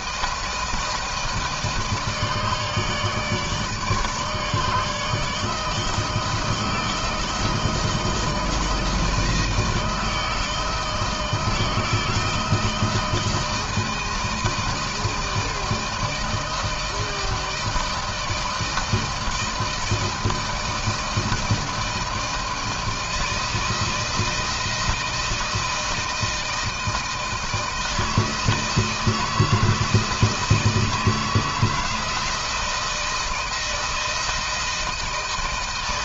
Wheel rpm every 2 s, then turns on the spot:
160, 160, 150, 160, 160, 160, 160, 160, 160, 160, 160, 160, 160, 160, 160, 160, 160, 160.
none